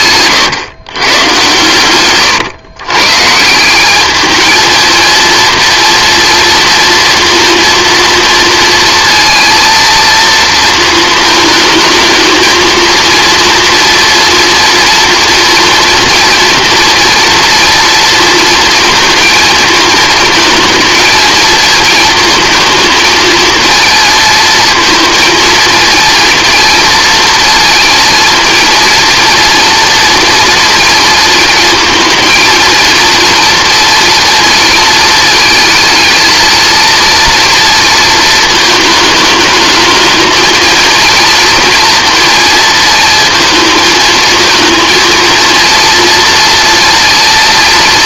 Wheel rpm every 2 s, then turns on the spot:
130, 120, 220, 230, 230, 230, 230, 230, 230, 230, 230, 230, 230, 230, 230, 240, 230, 230, 230, 220, 230, 230, 230, 230.
none